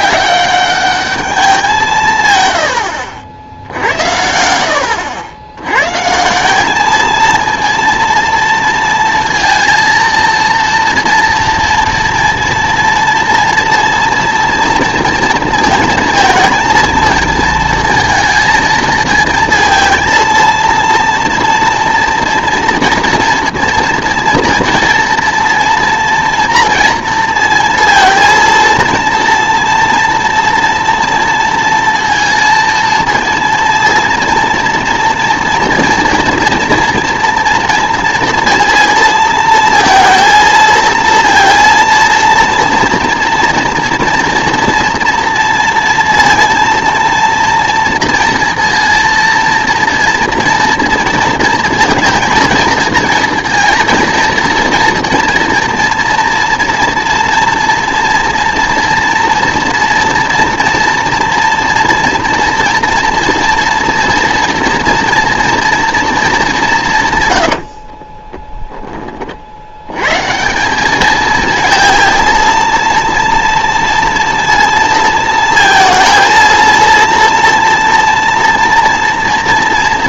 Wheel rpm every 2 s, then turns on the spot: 200, 90, 80, 200, 230, 230, 230, 230, 230, 230, 230, 240, 230, 230, 230, 230, 230, 230, 230, 230, 220, 240, 230, 230, 230, 230, 230, 230, 240, 230, 230, 230, 230, 180, 10, 190, 230, 230, 230, 230.
none